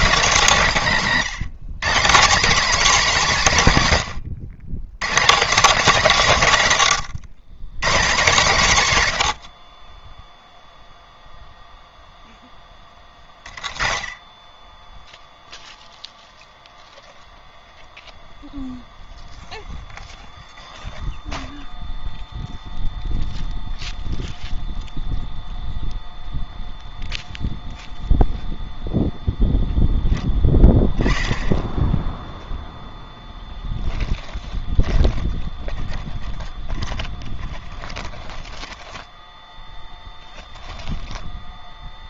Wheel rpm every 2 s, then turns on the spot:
160, 240, 140, 80, 0, 20, 10, 0, 0, 0, 0, 0, 0, 0, 0, 20, 10, 10, 10, 10, 10.
32-40